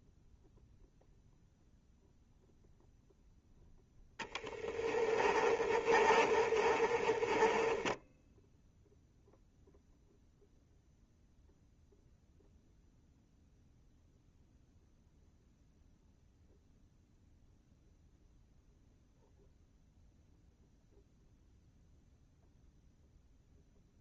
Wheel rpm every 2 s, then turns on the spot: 0, 0, 20, 30, 0, 0, 0, 0, 0, 0, 0, 0.
4-8